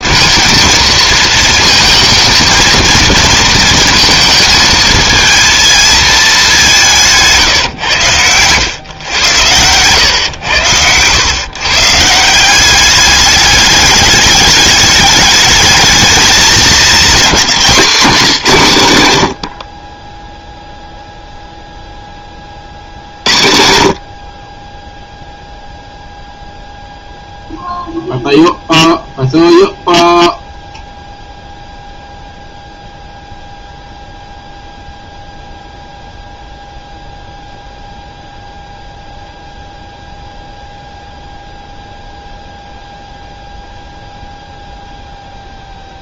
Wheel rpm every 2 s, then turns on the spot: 230, 230, 220, 190, 120, 110, 190, 210, 210, 160, 0, 40, 20, 0, 0, 0, 0, 0, 0, 0, 0, 0, 0.
none